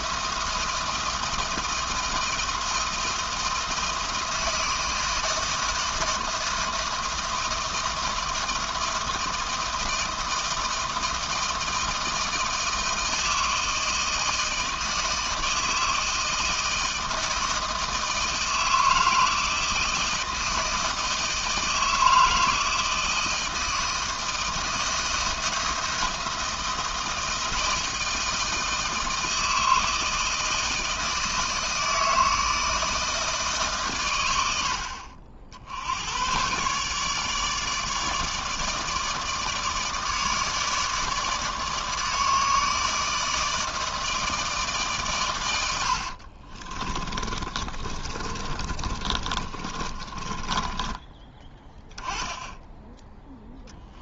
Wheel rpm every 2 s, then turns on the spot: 160, 170, 160, 160, 160, 160, 160, 160, 160, 160, 160, 160, 160, 170, 160, 160, 160, 80, 130, 150, 150, 150, 150, 40, 30, 20, 20.
46-52